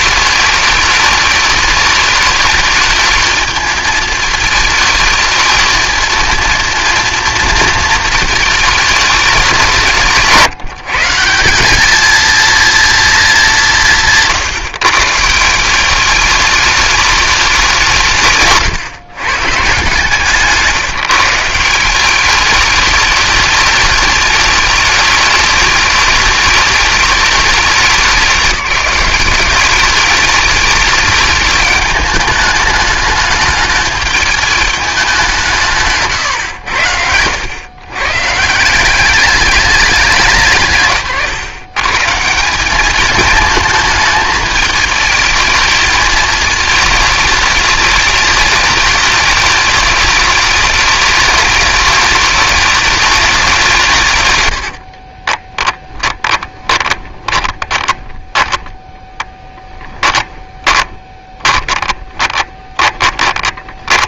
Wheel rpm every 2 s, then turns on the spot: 210, 210, 220, 230, 220, 150, 230, 140, 210, 130, 160, 210, 210, 210, 190, 210, 210, 210, 80, 190, 140, 200, 220, 220, 210, 210, 210, 60, 20, 10, 30, 20.
54-64